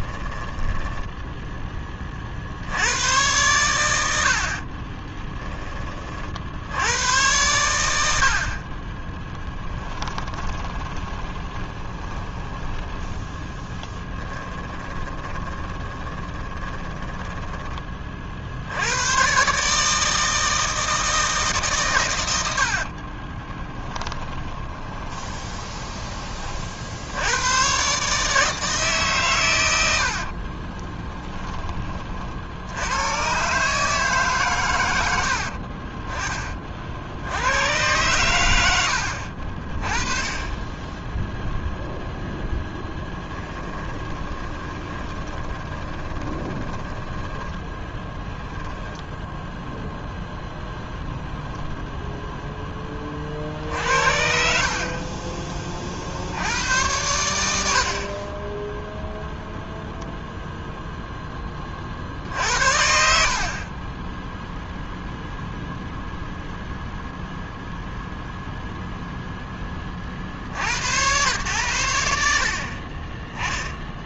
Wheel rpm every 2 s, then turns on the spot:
10, 80, 30, 90, 30, 20, 10, 20, 20, 90, 160, 60, 20, 60, 140, 30, 100, 110, 50, 70, 10, 10, 20, 10, 10, 0, 30, 50, 100, 0, 0, 60, 0, 0, 0, 100, 30.
0-2 4-6 10-12 14-18 22-26 30-32 42-48